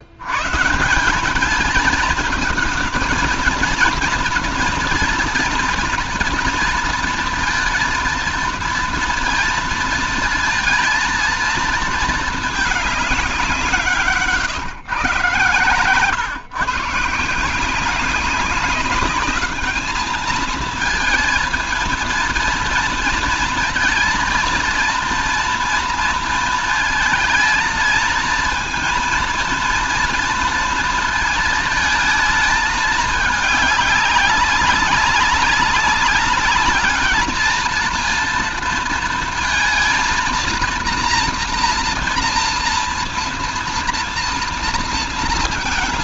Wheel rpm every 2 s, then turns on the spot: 130, 220, 220, 230, 230, 220, 220, 130, 130, 190, 220, 230, 230, 230, 230, 230, 220, 200, 210, 230, 230, 230, 230.
none